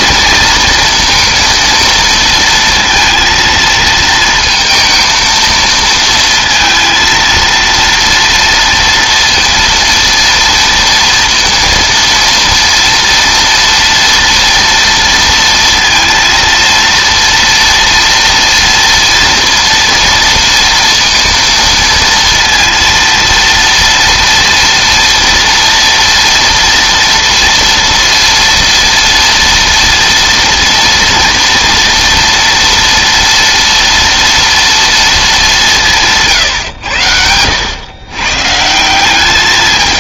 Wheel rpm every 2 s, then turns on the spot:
230, 230, 230, 230, 230, 230, 230, 230, 230, 230, 230, 230, 230, 230, 230, 230, 240, 230, 130, 160.
none